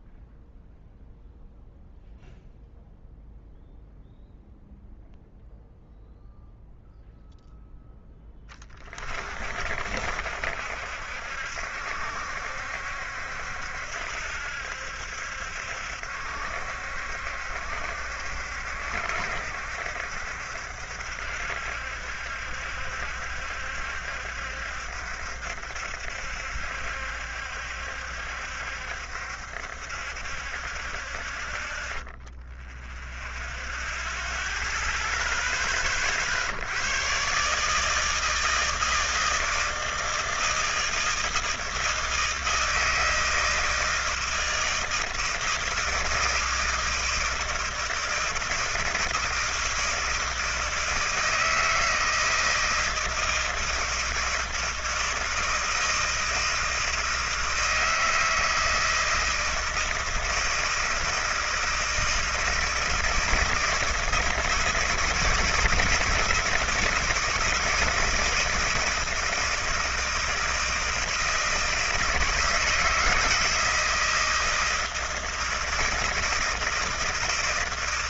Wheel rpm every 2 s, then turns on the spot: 0, 0, 0, 0, 20, 70, 70, 70, 70, 70, 70, 70, 70, 70, 70, 20, 0, 0, 90, 160, 160, 160, 160, 160, 160, 160, 160, 160, 160, 160, 160, 160, 160, 160, 160, 160, 170, 160, 160.
none